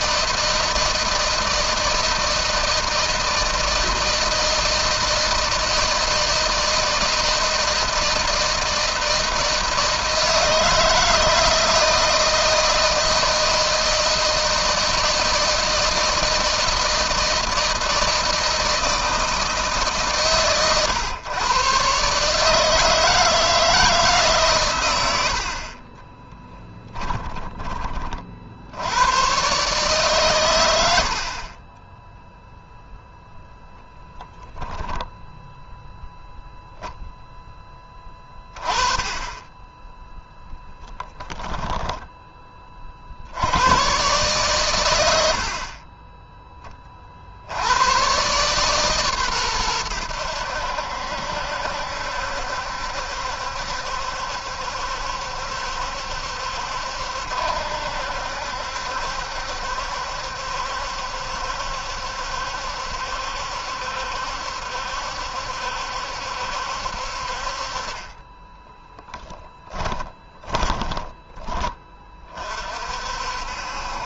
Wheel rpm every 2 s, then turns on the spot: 160, 160, 160, 160, 160, 160, 160, 160, 160, 160, 130, 150, 140, 20, 60, 110, 0, 10, 0, 20, 10, 30, 120, 20, 140, 80, 70, 70, 70, 70, 70, 70, 70, 70, 20, 20, 40.
26-28 68-72